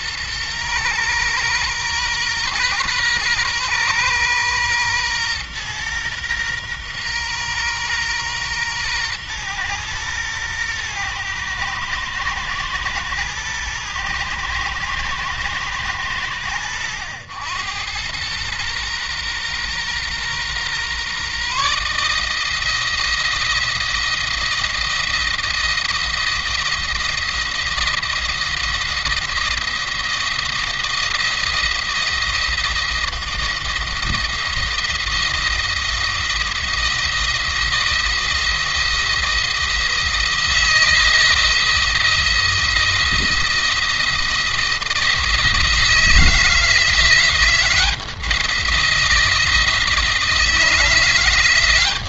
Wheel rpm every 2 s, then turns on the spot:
120, 120, 120, 120, 120, 120, 110, 120, 90, 120, 130, 160, 170, 170, 170, 170, 170, 170, 170, 170, 160, 170, 160, 170, 170, 170.
none